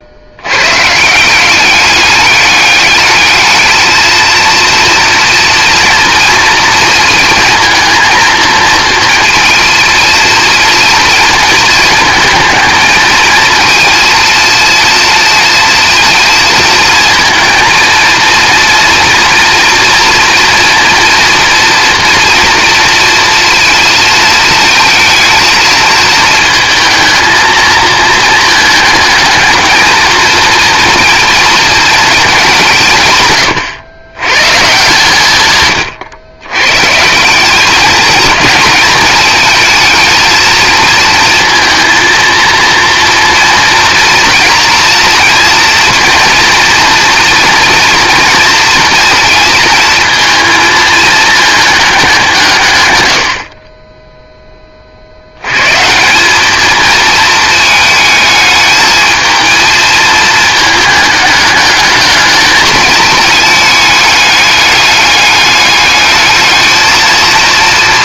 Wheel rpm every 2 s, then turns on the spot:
150, 210, 230, 220, 230, 230, 220, 230, 230, 230, 240, 240, 230, 220, 220, 230, 150, 140, 140, 220, 230, 230, 230, 230, 230, 220, 110, 60, 220, 220, 210, 220, 210, 220.
none